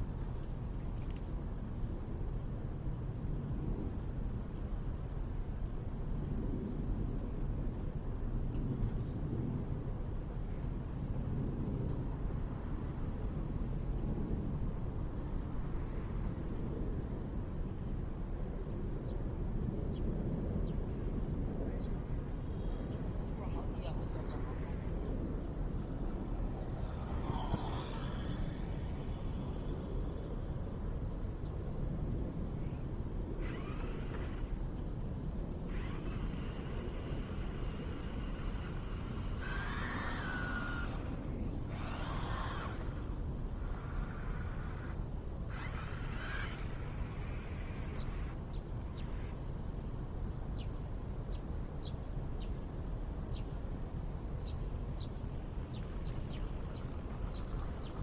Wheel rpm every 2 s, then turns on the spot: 0, 0, 0, 0, 0, 0, 0, 0, 0, 0, 0, 0, 0, 0, 0, 0, 0, 0, 0, 0, 0, 0, 0, 0, 0, 0, 0, 0, 0.
none